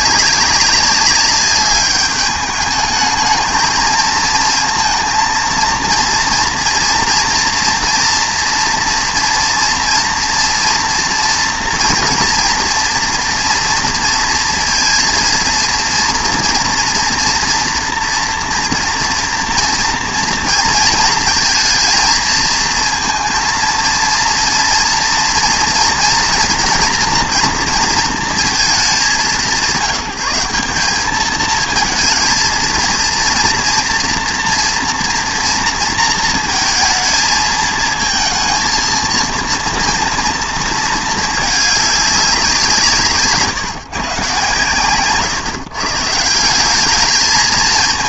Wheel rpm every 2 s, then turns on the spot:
200, 210, 230, 240, 230, 230, 230, 230, 230, 230, 230, 230, 230, 240, 210, 210, 230, 230, 230, 230, 230, 180, 120, 190.
none